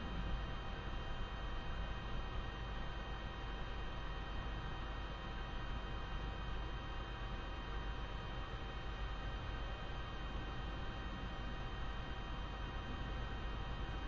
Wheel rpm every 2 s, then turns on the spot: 0, 0, 0, 0, 0, 0, 0.
none